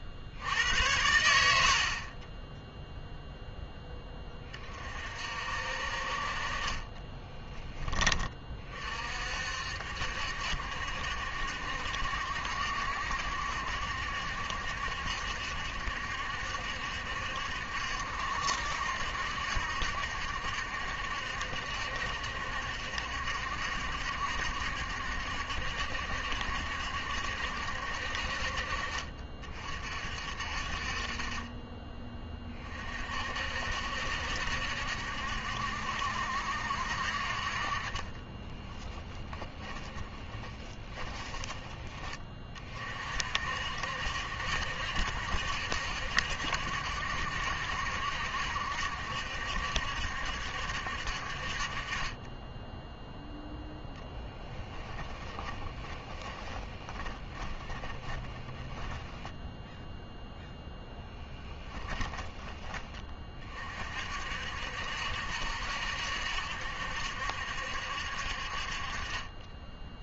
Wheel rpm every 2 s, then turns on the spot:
80, 0, 30, 30, 30, 60, 70, 70, 70, 70, 70, 60, 70, 70, 50, 50, 40, 70, 60, 10, 20, 40, 70, 70, 70, 60, 10, 10, 20, 10, 10, 20, 60, 70, 40.
6-8 38-42 54-60